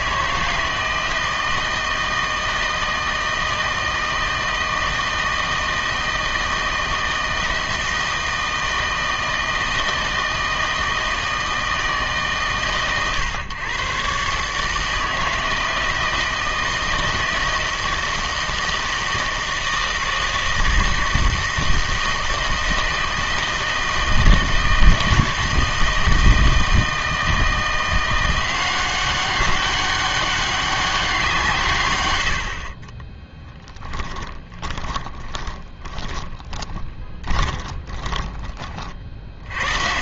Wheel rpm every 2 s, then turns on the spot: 160, 160, 160, 160, 160, 160, 120, 150, 160, 160, 160, 160, 160, 160, 180, 200, 50, 10, 20, 40.
32-38